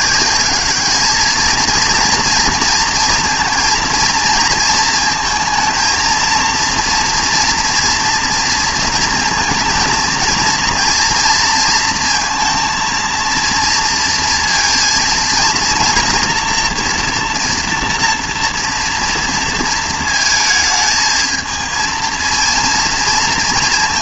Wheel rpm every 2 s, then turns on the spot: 200, 230, 230, 230, 230, 230, 230, 230, 230, 230, 220, 230.
none